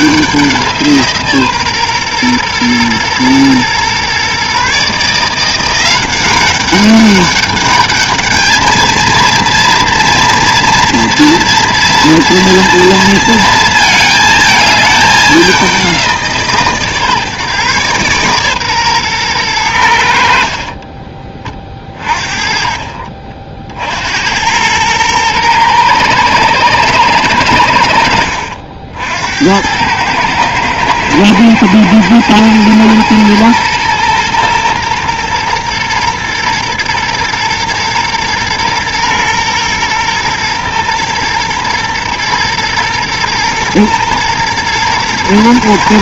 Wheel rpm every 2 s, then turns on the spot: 180, 120, 140, 200, 220, 230, 230, 220, 150, 130, 40, 40, 100, 110, 70, 110, 120, 120, 120, 120, 120, 120, 120.
20-24